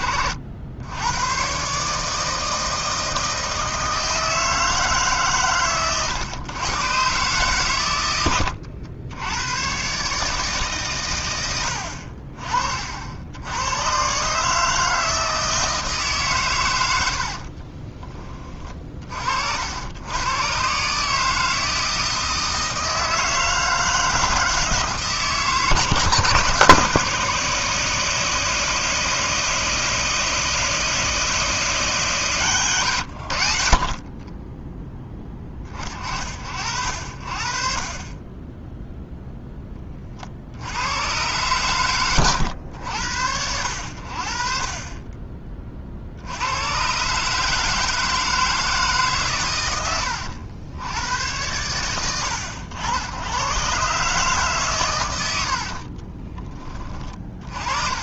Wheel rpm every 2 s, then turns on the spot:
100, 160, 150, 130, 90, 150, 60, 160, 110, 40, 140, 160, 160, 150, 160, 160, 110, 10, 60, 0, 90, 90, 40, 130, 150, 100, 90, 120, 30.
none